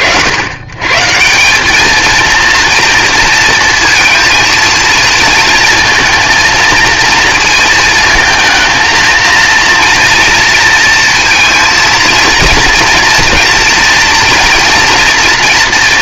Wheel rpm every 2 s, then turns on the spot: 110, 230, 230, 230, 220, 230, 230, 230.
none